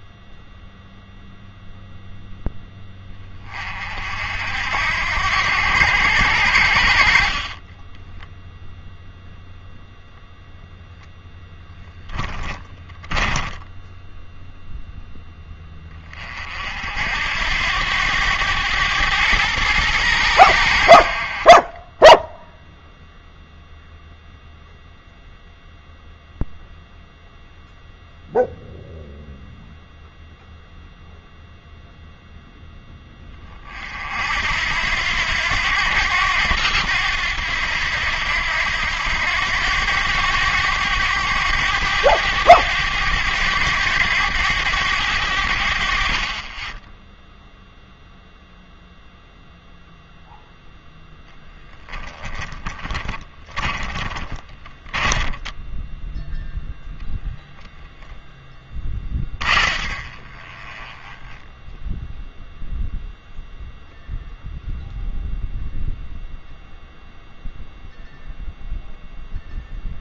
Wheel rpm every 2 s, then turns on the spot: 0, 10, 70, 80, 0, 0, 10, 0, 50, 100, 80, 0, 0, 0, 0, 0, 10, 80, 90, 90, 100, 100, 100, 20, 0, 0, 10, 20, 0, 20, 20, 0, 0, 0, 0.
12-14 52-56 58-62